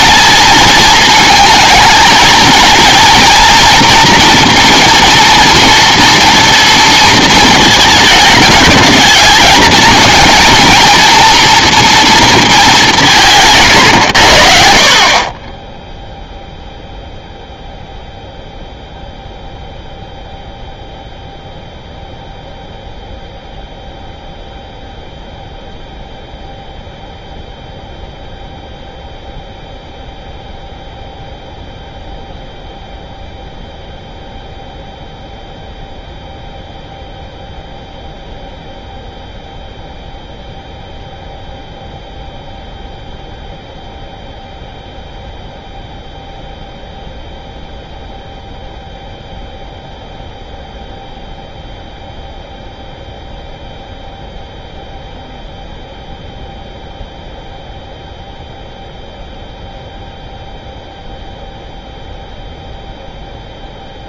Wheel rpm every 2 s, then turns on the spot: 230, 230, 230, 230, 220, 230, 210, 60, 0, 0, 0, 0, 0, 0, 0, 0, 0, 0, 0, 0, 0, 0, 0, 0, 0, 0, 0, 0, 0, 0, 0, 0.
none